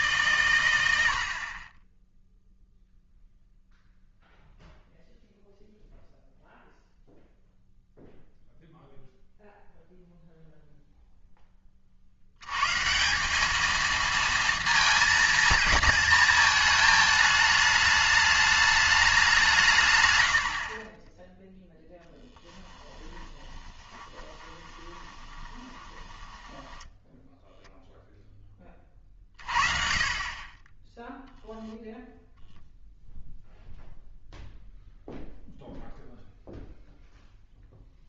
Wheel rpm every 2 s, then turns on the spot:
100, 0, 0, 0, 0, 0, 130, 230, 220, 210, 50, 10, 20, 10, 20, 20, 0, 0, 0.
24-28